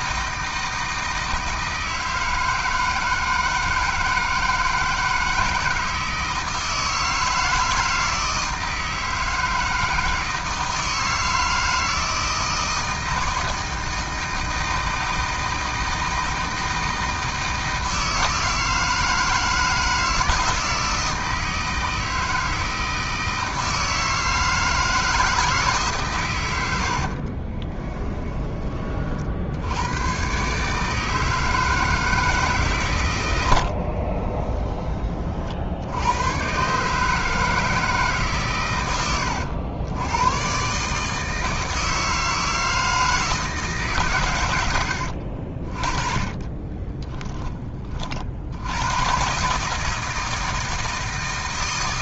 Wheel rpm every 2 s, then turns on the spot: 160, 160, 160, 160, 160, 160, 160, 160, 160, 160, 160, 160, 160, 70, 40, 160, 110, 30, 150, 100, 150, 160, 90, 20, 110, 160.
26-28 44-48